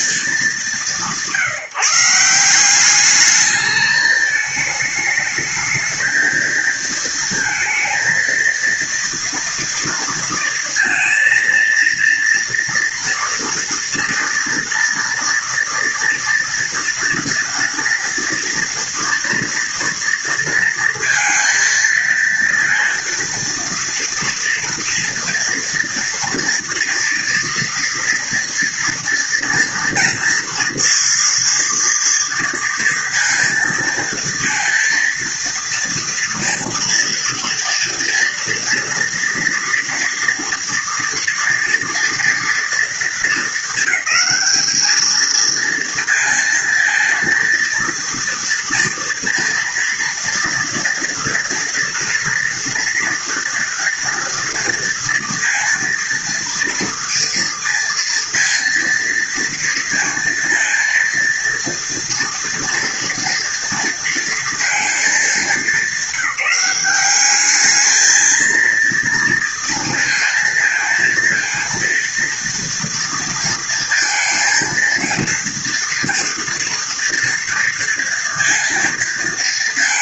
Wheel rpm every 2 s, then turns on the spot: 200, 180, 220, 220, 230, 230, 230, 230, 230, 240, 230, 230, 230, 230, 230, 230, 230, 230, 230, 230, 240, 230, 200, 230, 230, 230, 230, 230, 230, 230, 230, 230, 230, 190, 230, 230, 230, 230, 230, 230.
none